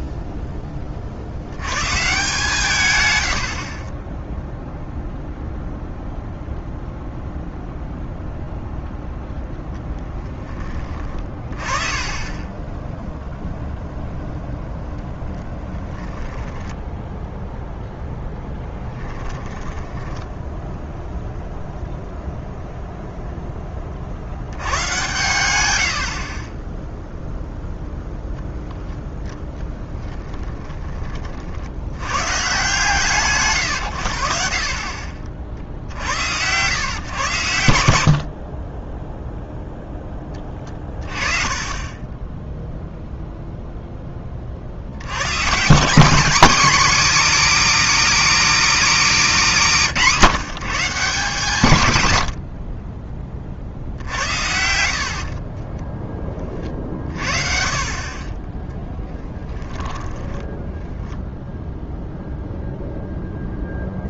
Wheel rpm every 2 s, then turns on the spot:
60, 70, 0, 0, 0, 20, 0, 10, 0, 10, 0, 0, 100, 0, 10, 30, 140, 40, 120, 10, 30, 0, 90, 270, 270, 180, 20, 60, 30, 10, 0, 0.
2-4 10-12 14-16 18-20 38-40 54-56 58-60